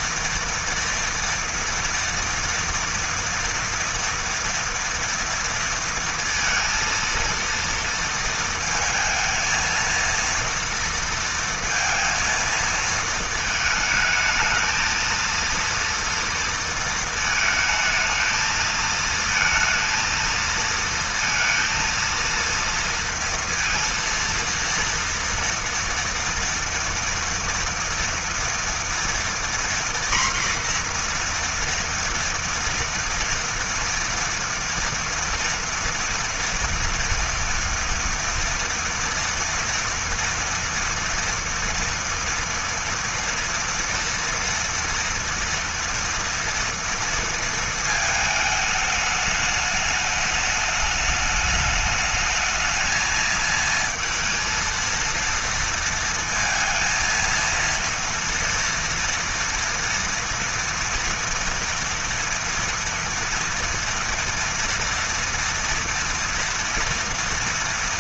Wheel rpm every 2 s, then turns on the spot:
230, 230, 240, 230, 220, 230, 220, 230, 220, 230, 230, 230, 230, 230, 240, 240, 230, 240, 240, 230, 230, 230, 230, 230, 210, 210, 220, 230, 230, 230, 230, 230, 230, 230.
none